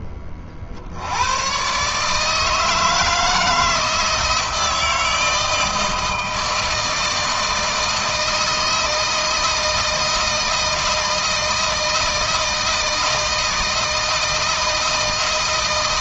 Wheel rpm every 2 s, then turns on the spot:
40, 160, 160, 160, 160, 160, 160, 160.
none